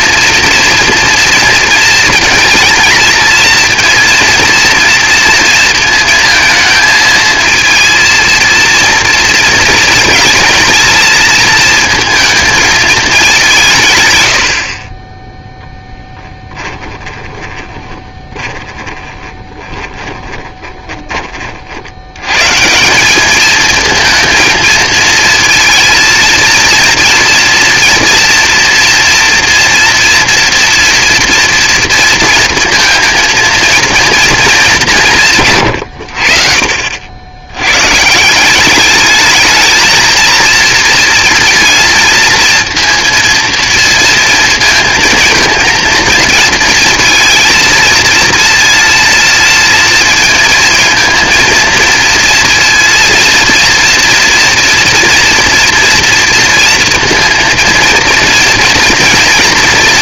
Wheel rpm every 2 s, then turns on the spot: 230, 220, 230, 230, 230, 220, 220, 60, 10, 20, 20, 150, 230, 230, 240, 240, 230, 210, 60, 200, 230, 230, 230, 230, 230, 230, 230, 230, 230, 230.
16-22